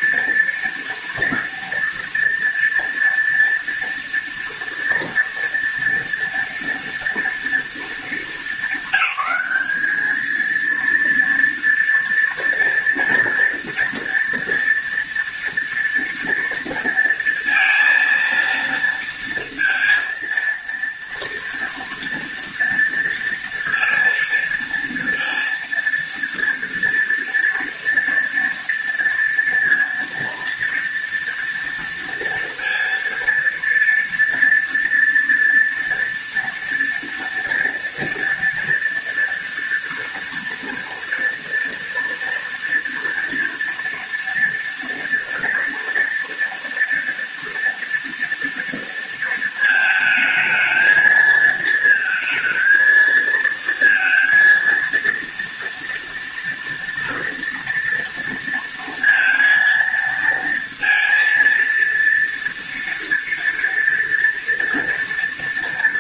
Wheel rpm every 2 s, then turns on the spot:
230, 230, 230, 230, 220, 220, 230, 230, 230, 230, 230, 230, 230, 230, 230, 230, 230, 230, 240, 230, 230, 230, 230, 240, 230, 220, 220, 230, 230, 230, 230, 230, 230.
none